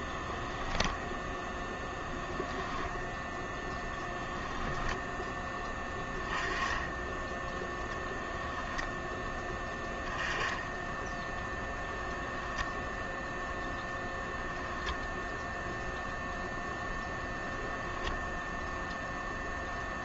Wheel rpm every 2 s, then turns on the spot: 0, 0, 0, 10, 0, 10, 0, 0, 0, 0.
none